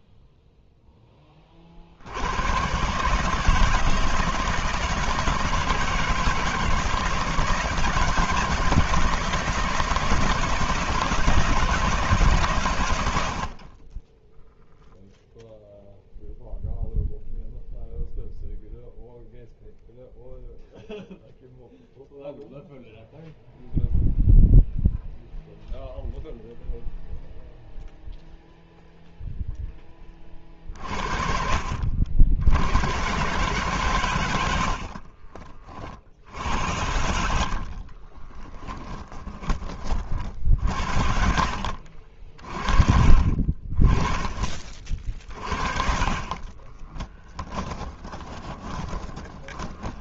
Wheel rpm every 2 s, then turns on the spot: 20, 140, 160, 170, 170, 160, 60, 0, 0, 0, 0, 0, 0, 0, 0, 60, 130, 40, 70, 10, 60, 30, 50, 20, 20.
34-36 44-50